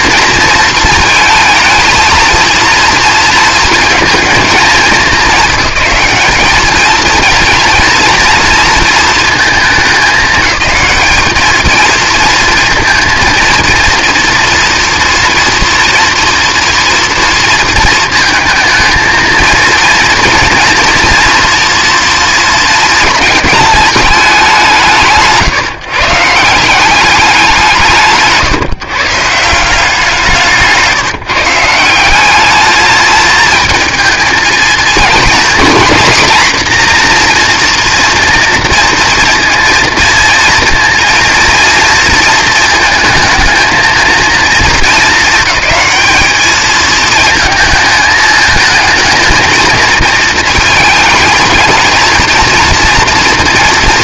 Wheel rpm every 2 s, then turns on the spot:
230, 230, 220, 220, 230, 210, 230, 230, 230, 220, 230, 230, 160, 170, 140, 170, 210, 230, 240, 230, 230, 230, 220, 220, 220, 230, 230.
30-32